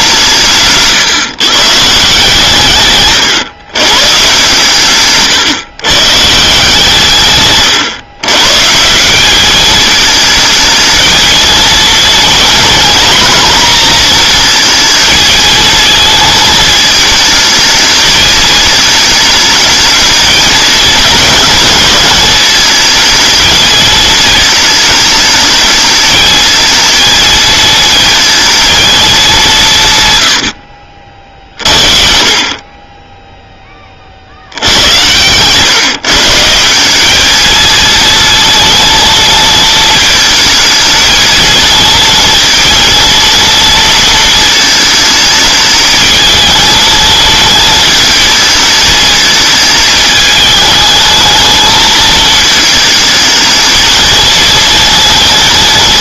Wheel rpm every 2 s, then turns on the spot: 140, 140, 140, 140, 160, 220, 230, 230, 220, 220, 210, 220, 220, 220, 220, 50, 30, 90, 180, 230, 220, 230, 220, 220, 220, 220, 220, 230.
0-2 34-36